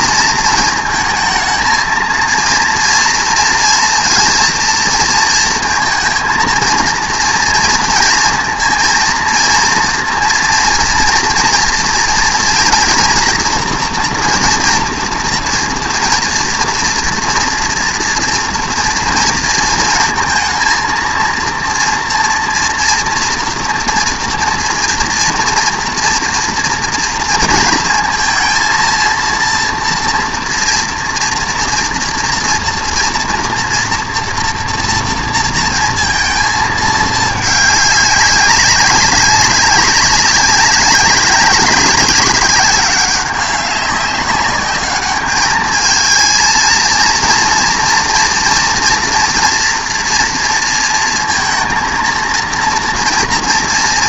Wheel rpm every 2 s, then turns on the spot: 220, 230, 230, 230, 230, 230, 240, 230, 230, 230, 230, 230, 230, 230, 230, 230, 240, 230, 220, 200, 190, 190, 200, 230, 230, 230, 230.
none